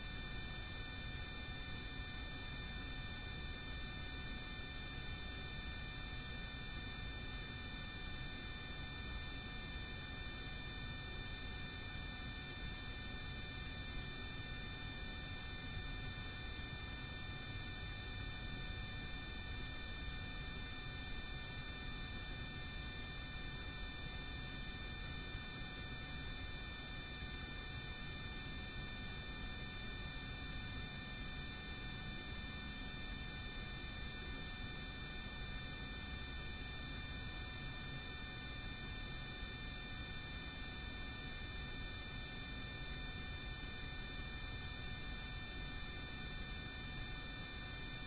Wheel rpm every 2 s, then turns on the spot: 0, 0, 0, 0, 0, 0, 0, 0, 0, 0, 0, 0, 0, 0, 0, 0, 0, 0, 0, 0, 0, 0, 0, 0.
none